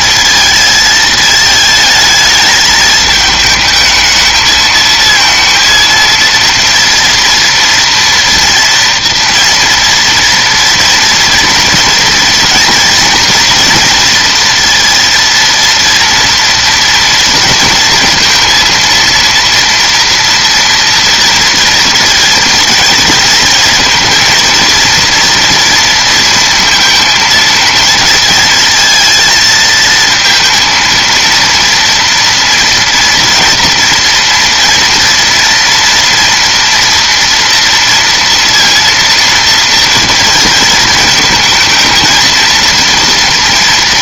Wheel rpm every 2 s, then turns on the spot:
220, 220, 230, 230, 240, 230, 230, 230, 230, 230, 230, 230, 230, 230, 220, 220, 230, 230, 240, 230, 220, 230.
none